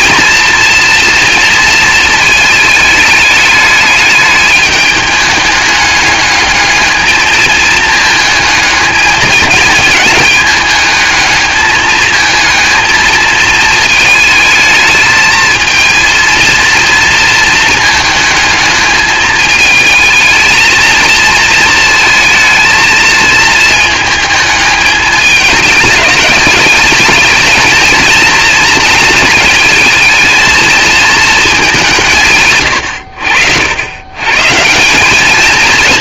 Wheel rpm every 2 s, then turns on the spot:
230, 210, 210, 220, 220, 210, 220, 220, 230, 220, 230, 220, 210, 210, 220, 220, 90, 180.
none